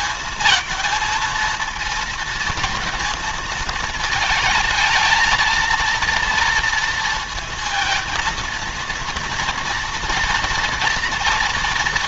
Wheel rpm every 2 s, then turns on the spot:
220, 230, 220, 230, 230, 230.
none